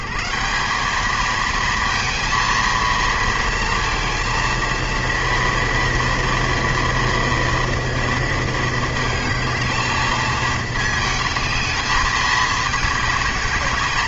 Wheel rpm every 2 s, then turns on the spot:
170, 230, 230, 240, 220, 220, 220.
none